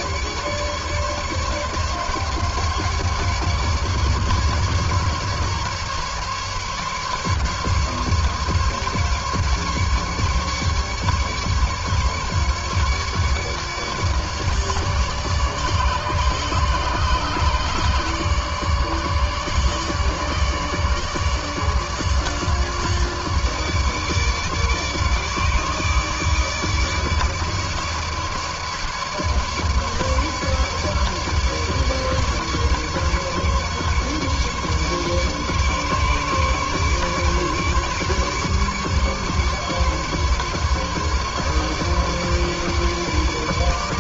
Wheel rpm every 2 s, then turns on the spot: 150, 150, 140, 150, 140, 150, 150, 150, 150, 150, 150, 150, 150, 150, 150, 150, 150, 140, 150, 150, 150, 150.
none